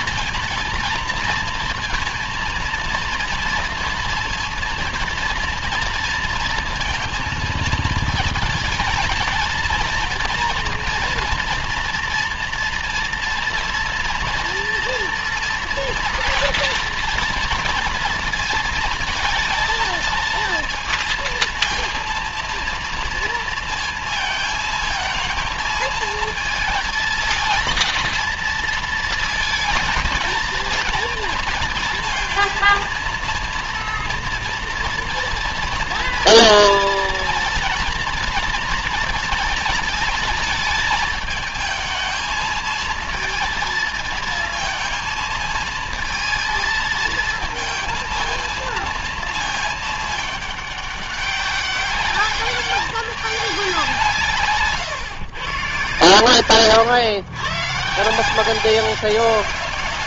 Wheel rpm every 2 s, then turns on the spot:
230, 230, 230, 230, 220, 230, 230, 230, 240, 220, 230, 230, 220, 220, 230, 230, 230, 240, 230, 230, 220, 230, 220, 230, 230, 200, 200, 140, 120, 190.
none